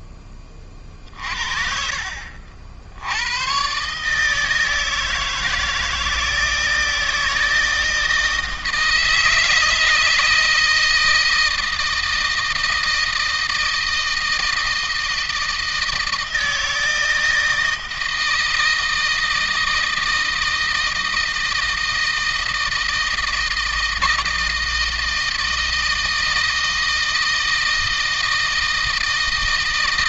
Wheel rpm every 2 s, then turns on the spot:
30, 80, 160, 160, 160, 160, 160, 160, 160, 160, 160, 160, 160, 160, 160.
none